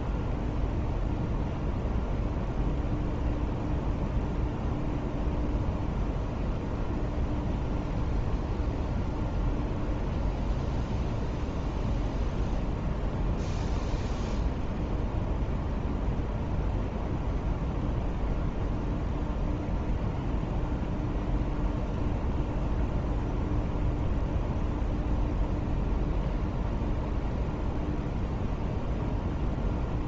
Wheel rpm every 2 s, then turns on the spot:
0, 0, 0, 0, 0, 0, 0, 0, 0, 0, 0, 0, 0, 0, 0.
none